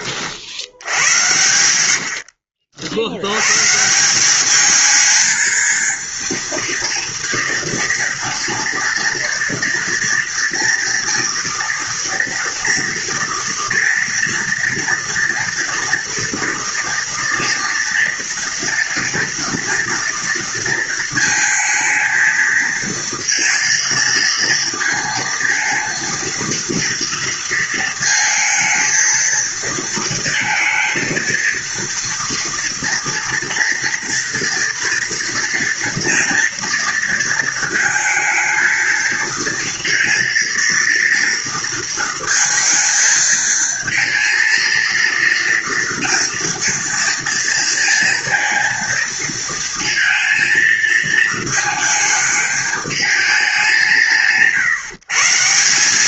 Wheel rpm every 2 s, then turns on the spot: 70, 60, 200, 230, 230, 230, 230, 230, 230, 230, 230, 230, 230, 230, 230, 220, 230, 230, 230, 230, 230, 220, 230, 230, 230, 230, 220, 150.
none